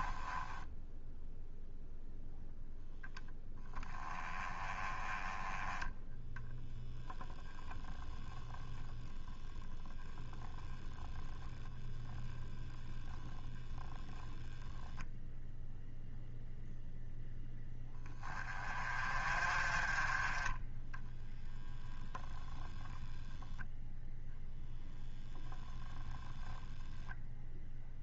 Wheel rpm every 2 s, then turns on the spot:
0, 0, 20, 0, 10, 10, 0, 0, 0, 30, 10, 0, 0, 0.
10-12